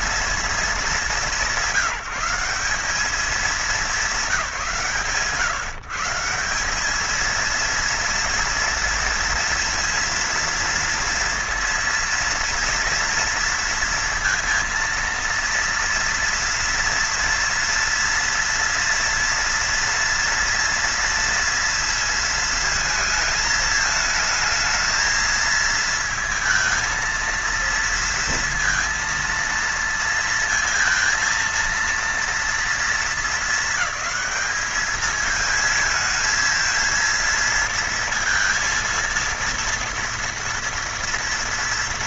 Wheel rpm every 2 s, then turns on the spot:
210, 190, 150, 190, 230, 230, 230, 230, 230, 240, 230, 230, 220, 220, 230, 230, 230, 220, 230, 230, 230.
none